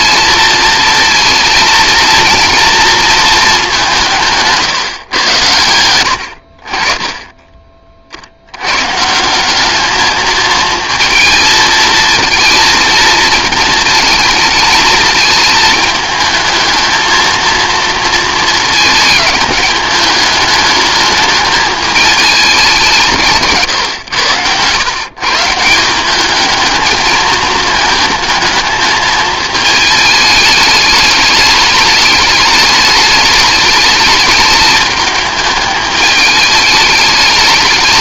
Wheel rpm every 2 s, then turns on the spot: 230, 230, 160, 60, 90, 220, 220, 220, 220, 220, 210, 200, 110, 210, 220, 210, 210, 210, 210.
none